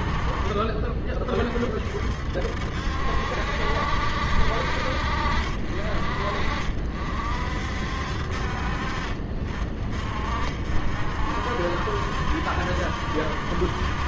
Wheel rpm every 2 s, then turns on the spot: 40, 60, 60, 50, 40, 50, 70.
none